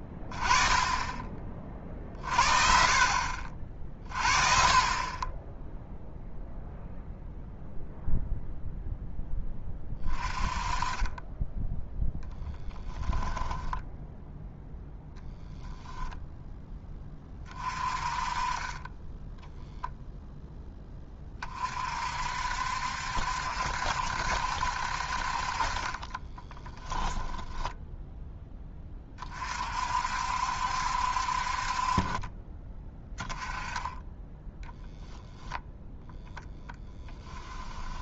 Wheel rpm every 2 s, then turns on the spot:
20, 40, 30, 0, 0, 20, 10, 0, 0, 30, 10, 60, 60, 10, 20, 60, 20, 10, 10.
12-14 26-28 34-38